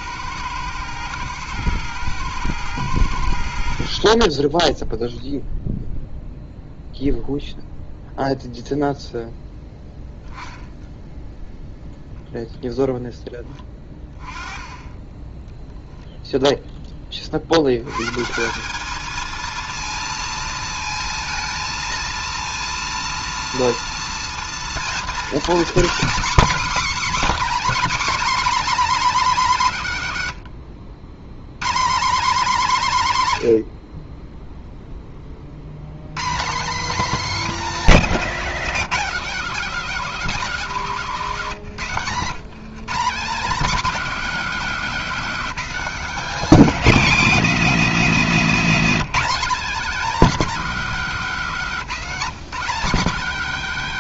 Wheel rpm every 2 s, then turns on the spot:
110, 110, 10, 0, 0, 0, 0, 20, 0, 180, 230, 230, 230, 280, 300, 110, 200, 0, 210, 250, 240, 170, 230, 260, 240, 230, 220.
30-32